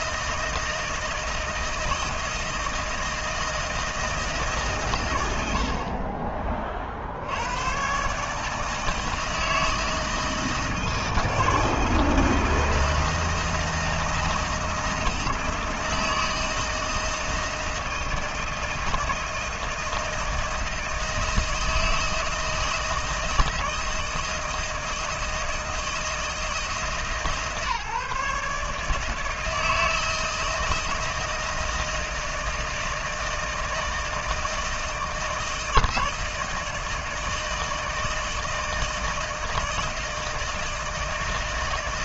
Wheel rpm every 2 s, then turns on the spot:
160, 160, 130, 40, 150, 160, 160, 160, 160, 160, 160, 160, 160, 150, 150, 160, 160, 160, 160, 160, 160.
none